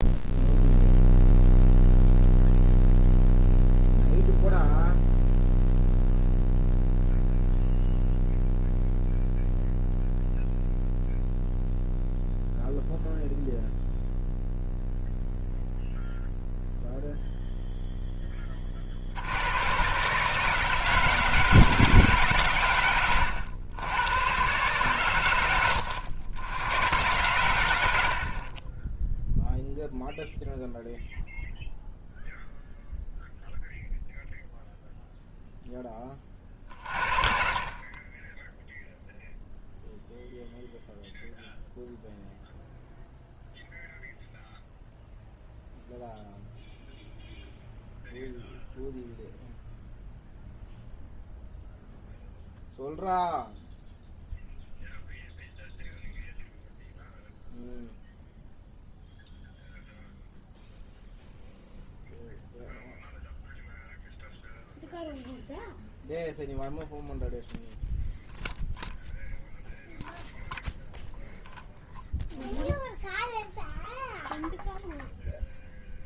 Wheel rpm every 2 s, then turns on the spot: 0, 0, 0, 0, 0, 0, 0, 0, 0, 50, 160, 100, 120, 110, 10, 0, 0, 0, 30, 0, 0, 0, 0, 0, 0, 0, 0, 0, 0, 0, 0, 0, 0, 0, 0, 0, 0, 0.
22-24 36-38